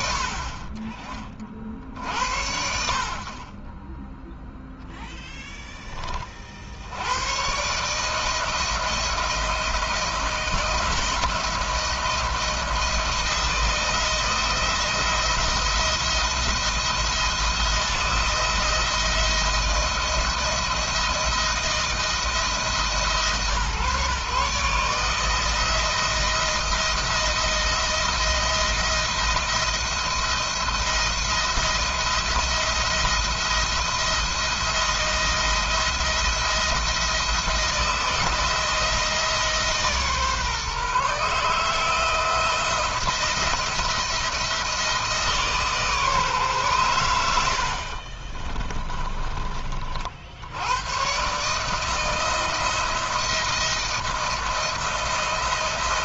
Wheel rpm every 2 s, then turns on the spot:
40, 60, 0, 60, 160, 160, 170, 170, 170, 170, 170, 150, 150, 170, 170, 170, 170, 170, 170, 160, 140, 170, 160, 120, 20, 90, 170, 170.
48-50